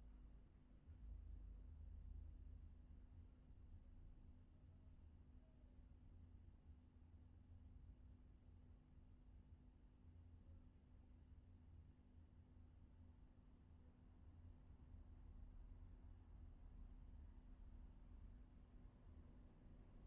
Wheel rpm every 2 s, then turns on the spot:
0, 0, 0, 0, 0, 0, 0, 0, 0, 0.
none